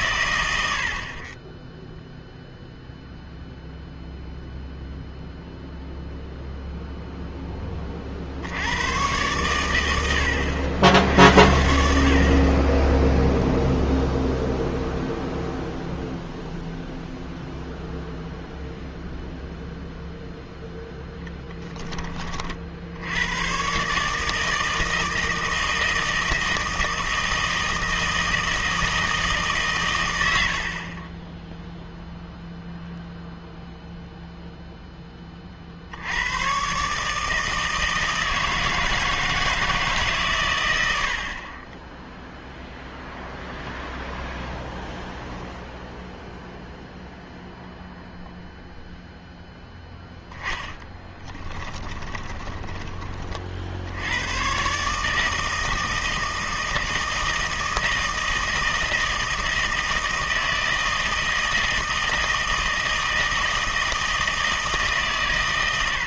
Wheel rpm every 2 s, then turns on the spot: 70, 0, 0, 0, 90, 80, 30, 0, 0, 0, 0, 60, 160, 160, 160, 70, 0, 0, 120, 160, 120, 0, 0, 0, 0, 10, 20, 130, 160, 160, 160, 160, 160.
50-54